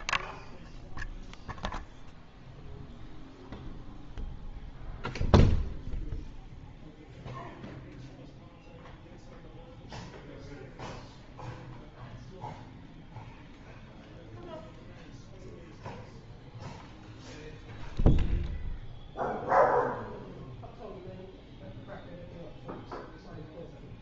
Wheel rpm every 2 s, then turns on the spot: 0, 0, 0, 0, 0, 0, 0, 0, 0, 0, 0, 0.
none